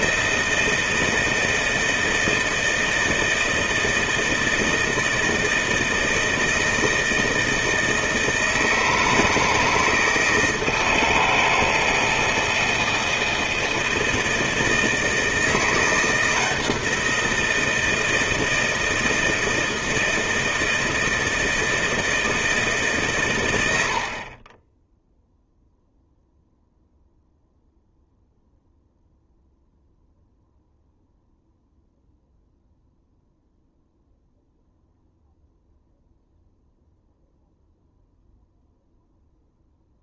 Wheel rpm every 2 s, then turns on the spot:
160, 160, 160, 160, 160, 160, 160, 160, 170, 160, 160, 150, 10, 0, 0, 0, 0, 0, 0, 0.
none